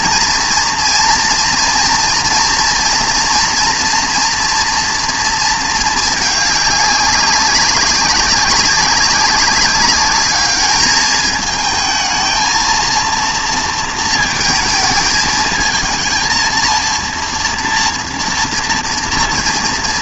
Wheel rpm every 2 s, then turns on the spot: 230, 230, 230, 200, 190, 210, 220, 220, 230, 240.
none